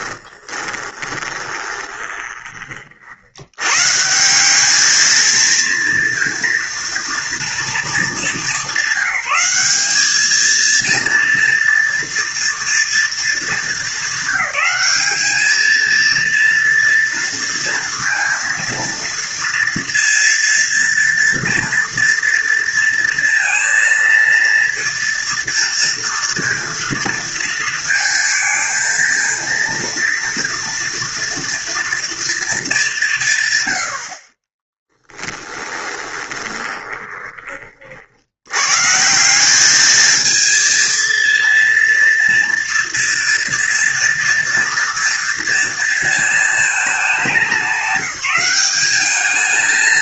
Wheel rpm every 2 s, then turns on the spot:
20, 20, 180, 230, 200, 220, 230, 200, 230, 230, 230, 230, 230, 230, 230, 230, 220, 30, 20, 100, 220, 230, 230, 220, 190.
0-2 34-38